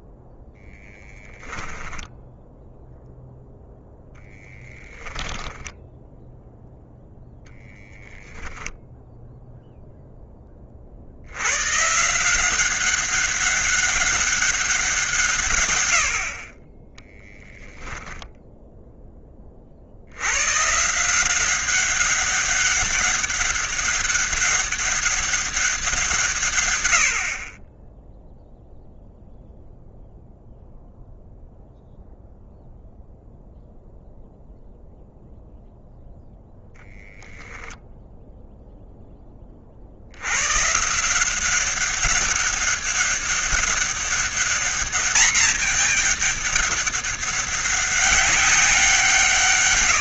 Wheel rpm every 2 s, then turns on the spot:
0, 0, 10, 0, 0, 40, 190, 180, 20, 10, 150, 200, 200, 100, 0, 0, 0, 0, 0, 0, 140, 190, 210, 200, 180.
4-6